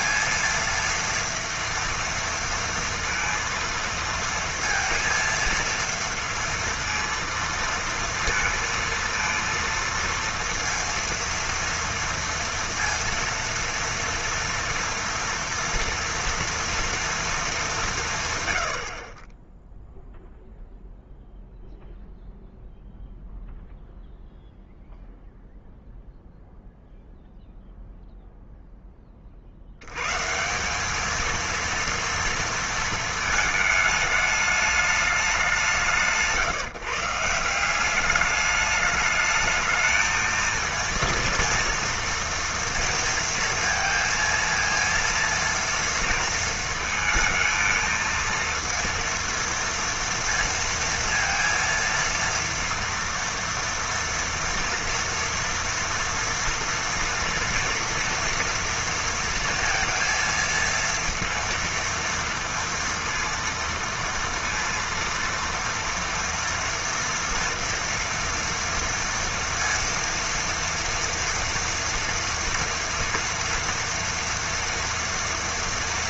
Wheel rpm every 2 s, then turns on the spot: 230, 230, 230, 230, 230, 230, 230, 230, 230, 80, 0, 0, 0, 0, 10, 180, 230, 210, 150, 210, 230, 230, 230, 230, 230, 230, 230, 230, 230, 230, 230, 230, 230, 240, 230, 230, 230, 230.
none